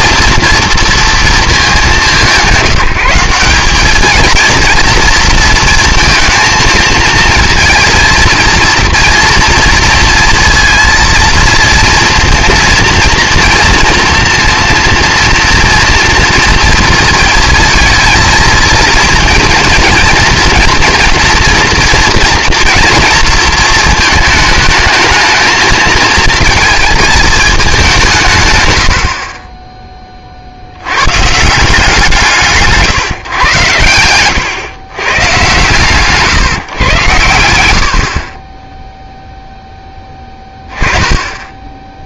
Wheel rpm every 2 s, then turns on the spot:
230, 170, 230, 220, 230, 230, 230, 230, 230, 230, 240, 230, 210, 220, 100, 80, 160, 120, 130, 20, 10.
28-30